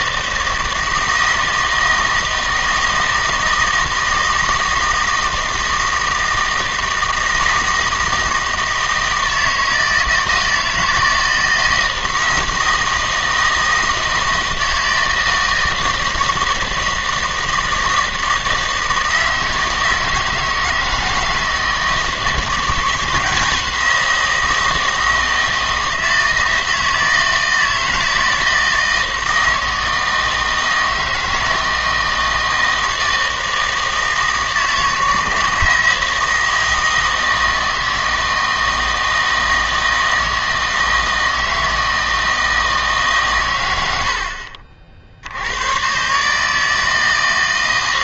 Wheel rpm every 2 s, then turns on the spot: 160, 160, 160, 160, 160, 160, 160, 160, 160, 160, 160, 170, 160, 160, 160, 160, 160, 160, 160, 160, 160, 160, 60, 160.
none